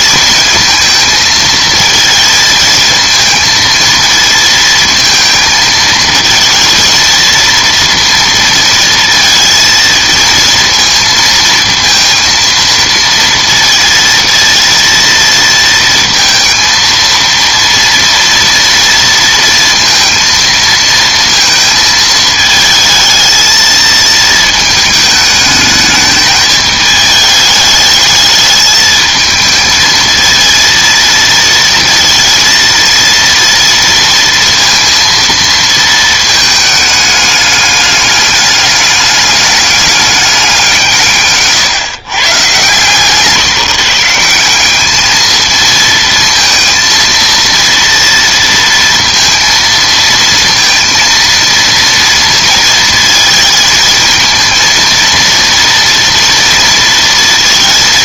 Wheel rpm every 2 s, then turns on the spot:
230, 230, 230, 230, 230, 230, 230, 230, 230, 230, 230, 220, 220, 210, 220, 230, 230, 230, 220, 200, 180, 140, 200, 230, 230, 230, 220, 230, 230.
none